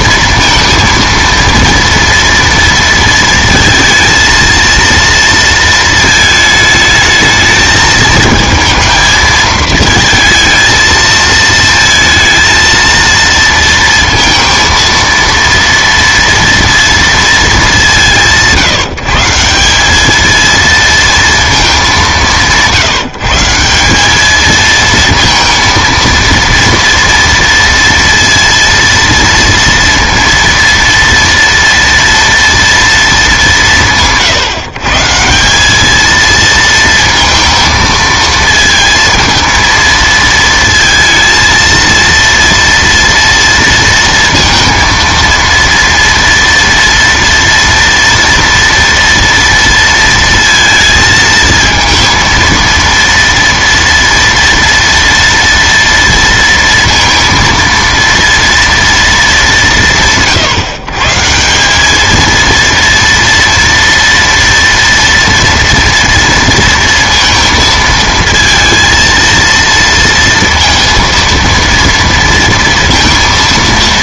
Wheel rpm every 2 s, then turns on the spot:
230, 230, 230, 220, 220, 220, 230, 230, 230, 160, 230, 170, 220, 230, 230, 230, 230, 140, 230, 220, 220, 230, 230, 230, 230, 230, 230, 230, 230, 230, 160, 230, 230, 230, 230, 230, 230.
none